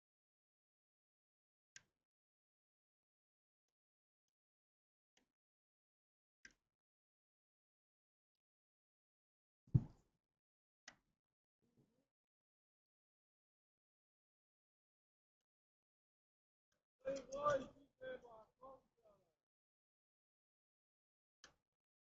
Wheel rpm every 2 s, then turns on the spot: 0, 0, 0, 0, 0, 0, 0, 0, 0, 0, 0.
none